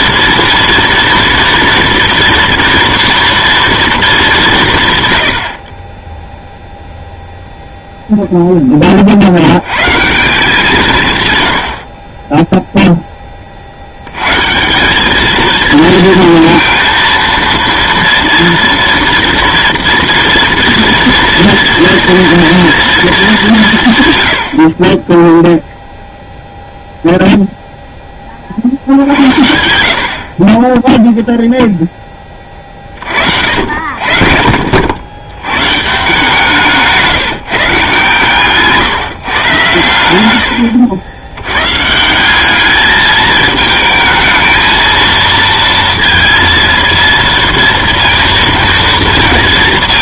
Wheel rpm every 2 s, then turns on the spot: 230, 230, 170, 0, 10, 170, 10, 150, 230, 230, 230, 230, 70, 0, 60, 20, 20, 70, 160, 140, 90, 200, 220, 230, 230.
38-40